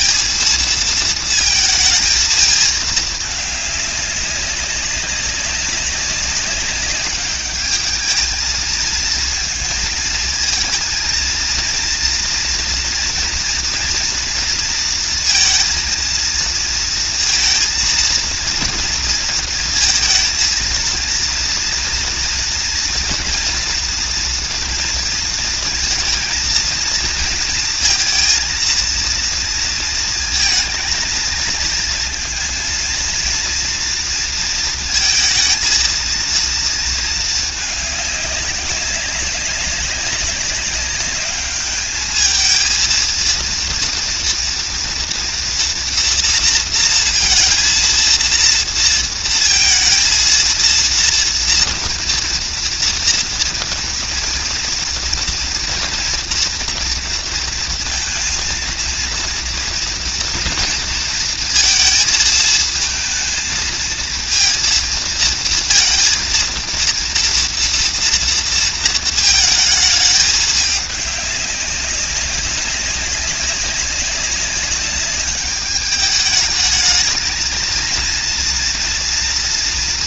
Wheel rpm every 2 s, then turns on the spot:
230, 220, 200, 200, 220, 220, 230, 230, 230, 230, 230, 230, 230, 230, 230, 230, 230, 230, 230, 200, 200, 220, 230, 230, 230, 230, 230, 230, 230, 230, 230, 230, 230, 230, 230, 210, 190, 200, 210, 230.
none